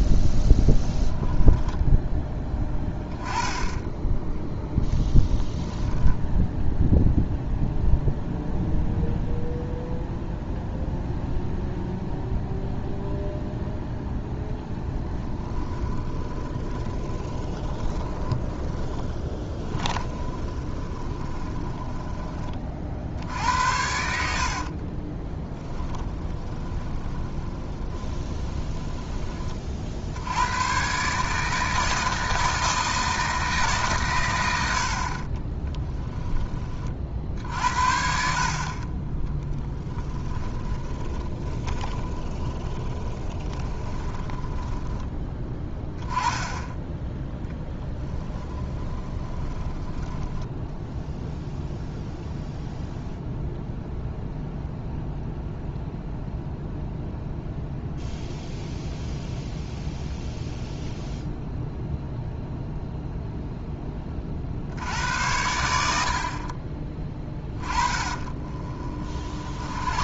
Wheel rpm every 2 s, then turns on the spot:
0, 10, 0, 0, 0, 0, 0, 10, 20, 10, 20, 40, 50, 20, 10, 130, 160, 80, 40, 30, 20, 20, 10, 10, 20, 0, 0, 0, 0, 0, 0, 0, 70, 30, 30.
16-22 24-28 40-46 48-50 68-70